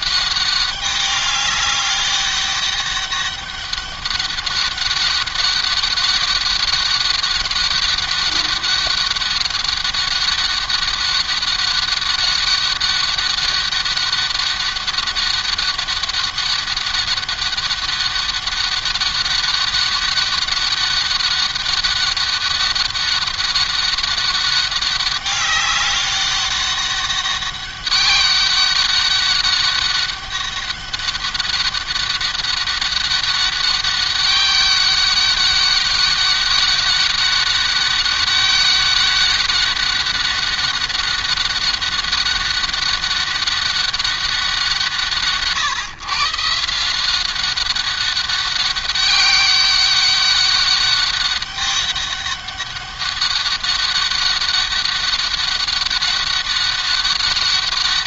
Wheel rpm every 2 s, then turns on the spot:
200, 200, 200, 200, 200, 200, 200, 200, 200, 200, 200, 200, 200, 200, 200, 200, 200, 200, 200, 200, 200, 200, 170, 160, 200, 200, 200, 200, 200.
none